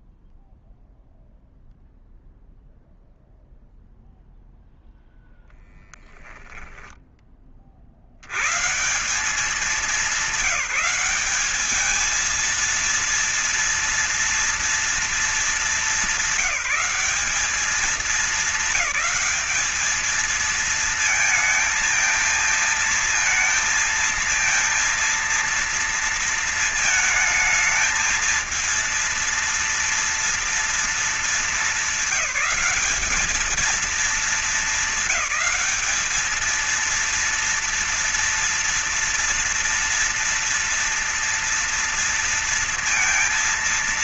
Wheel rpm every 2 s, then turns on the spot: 0, 0, 0, 10, 130, 190, 230, 230, 190, 210, 230, 230, 230, 220, 230, 230, 210, 220, 220, 230, 240, 230.
none